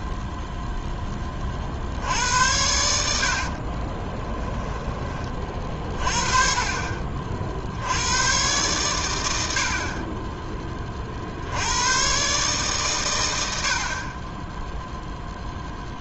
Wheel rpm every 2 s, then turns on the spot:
0, 80, 10, 40, 120, 30, 140, 20.
4-6